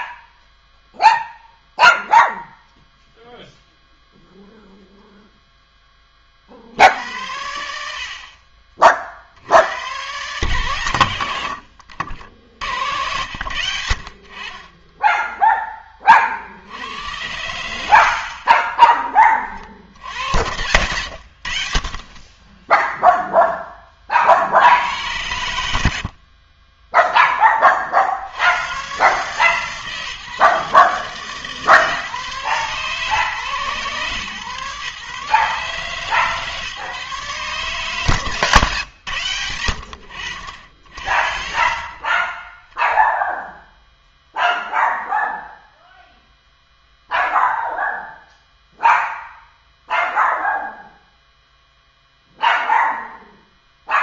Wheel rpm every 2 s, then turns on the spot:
0, 0, 0, 70, 30, 110, 80, 20, 90, 20, 100, 0, 90, 10, 130, 150, 140, 140, 150, 130, 60, 0, 0, 0, 0, 0, 0.
18-22